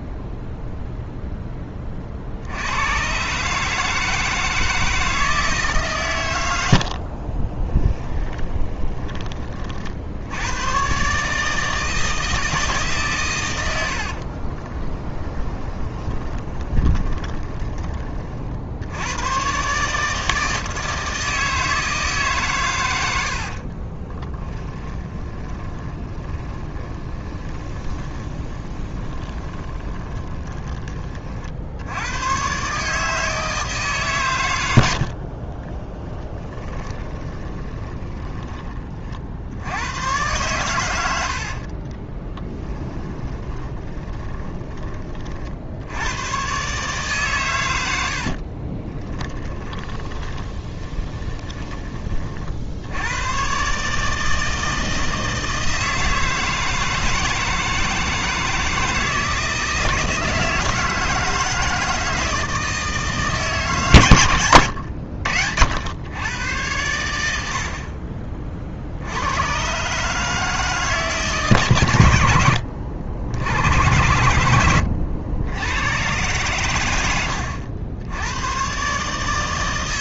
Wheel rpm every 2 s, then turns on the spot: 0, 90, 160, 80, 10, 110, 150, 20, 20, 70, 160, 130, 20, 20, 20, 20, 130, 80, 20, 20, 110, 20, 20, 130, 50, 20, 70, 160, 160, 160, 160, 160, 80, 110, 40, 160, 80, 100, 110, 120.
8-10 14-18 24-30 36-38 42-46 48-52